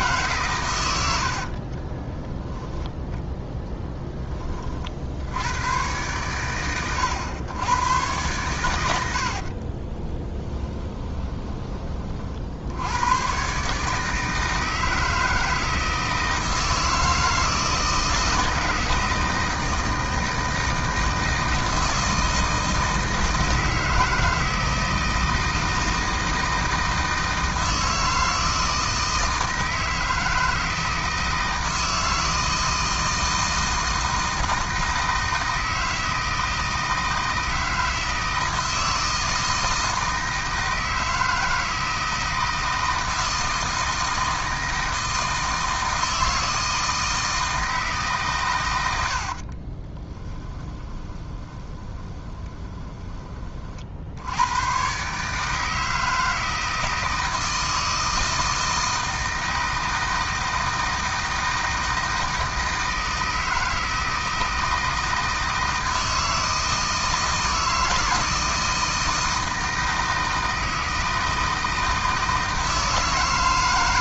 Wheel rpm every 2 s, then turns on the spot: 110, 10, 40, 110, 100, 20, 80, 160, 160, 160, 160, 160, 160, 160, 160, 160, 160, 160, 160, 160, 160, 160, 160, 160, 100, 20, 20, 110, 160, 160, 160, 160, 160, 160, 160, 160, 160.
10-12 50-54